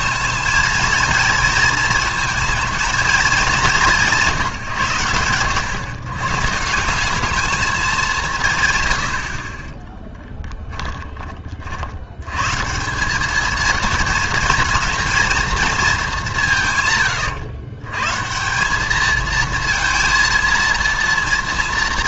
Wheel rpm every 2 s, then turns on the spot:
220, 220, 150, 170, 120, 10, 150, 220, 150, 190, 230.
10-12